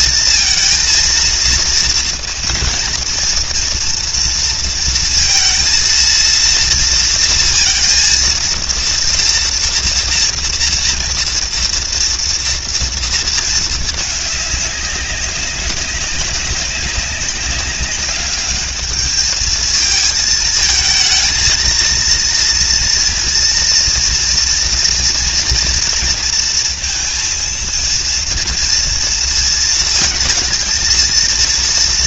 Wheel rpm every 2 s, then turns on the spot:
220, 230, 230, 230, 230, 230, 230, 200, 190, 210, 220, 230, 230, 230, 230, 230.
none